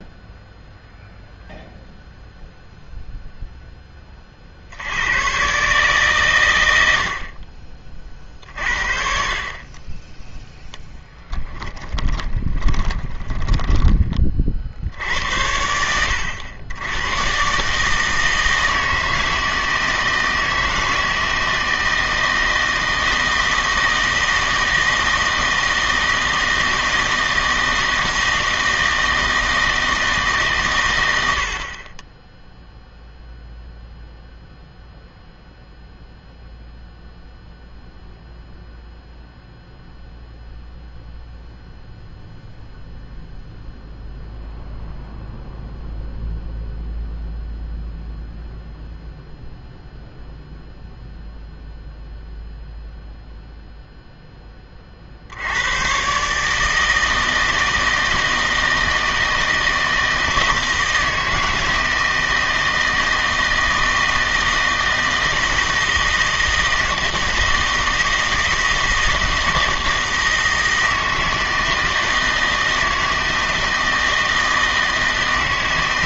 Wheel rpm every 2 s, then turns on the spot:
0, 0, 70, 80, 50, 10, 10, 70, 100, 160, 160, 160, 160, 160, 160, 120, 0, 0, 0, 0, 0, 0, 0, 0, 0, 0, 0, 30, 160, 160, 160, 160, 160, 160, 160, 160, 160, 160.
10-14